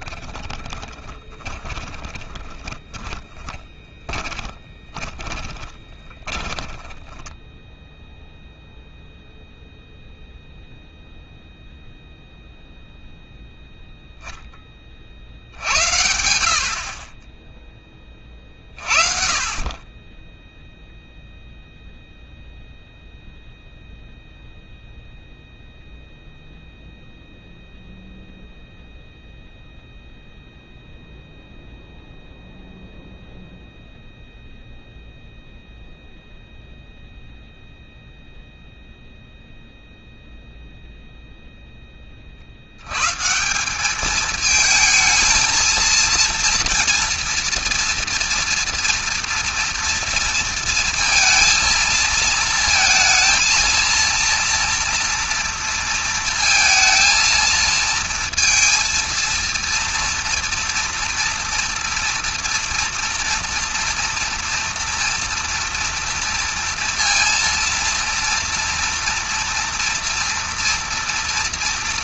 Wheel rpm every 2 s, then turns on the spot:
20, 20, 20, 20, 0, 0, 0, 20, 50, 50, 0, 0, 0, 0, 0, 0, 0, 0, 0, 0, 0, 90, 220, 230, 230, 230, 230, 230, 230, 230, 230, 230, 230, 230, 240, 230.
0-8